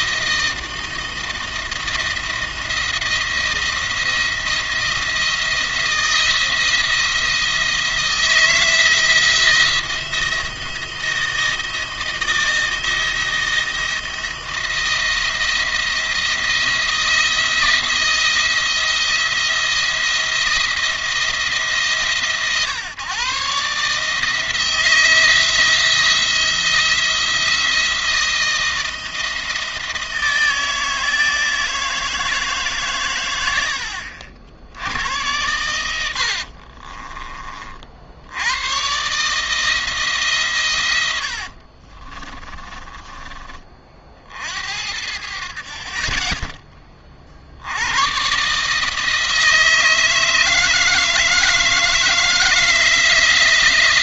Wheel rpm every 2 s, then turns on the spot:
160, 170, 170, 160, 160, 170, 170, 170, 160, 170, 170, 140, 160, 170, 160, 160, 140, 90, 40, 110, 110, 30, 70, 20, 150, 160, 160.
36-38 40-44